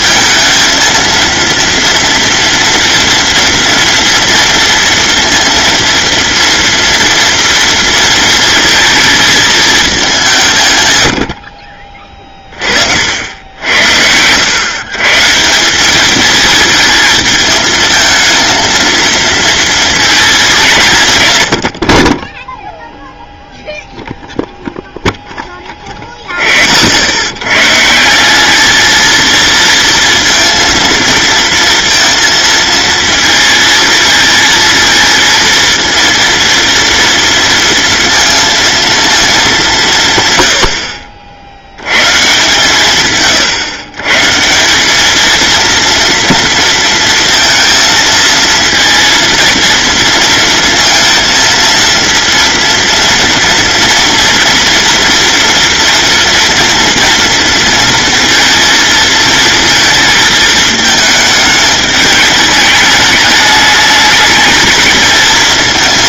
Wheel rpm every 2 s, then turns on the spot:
230, 240, 230, 230, 230, 110, 60, 130, 220, 230, 170, 0, 0, 80, 220, 230, 230, 230, 230, 230, 50, 140, 200, 230, 230, 230, 230, 230, 240, 230, 210, 210, 220.
none